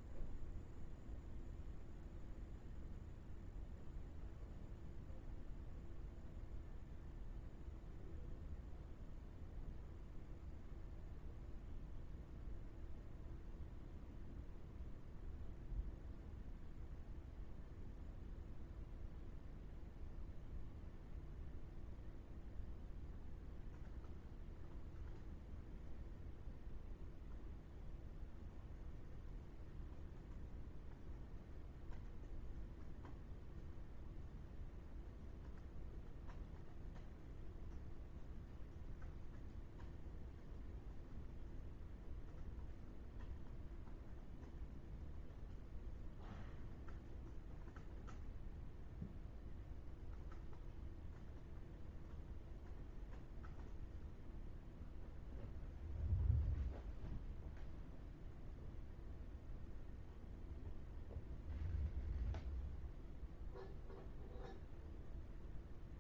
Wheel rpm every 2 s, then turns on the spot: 0, 0, 0, 0, 0, 0, 0, 0, 0, 0, 0, 0, 0, 0, 0, 0, 0, 0, 0, 0, 0, 0, 0, 0, 0, 0, 0, 0, 0, 0, 0, 0, 0.
none